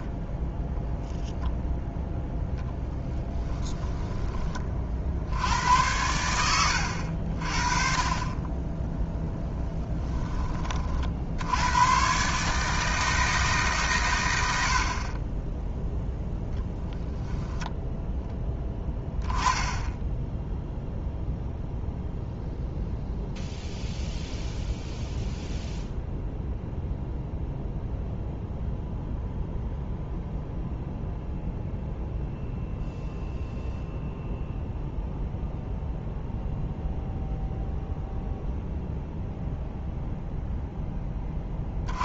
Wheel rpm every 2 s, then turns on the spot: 0, 10, 40, 80, 10, 30, 150, 60, 0, 10, 0, 0, 0, 0, 0, 0, 0, 0, 0, 0, 10.
none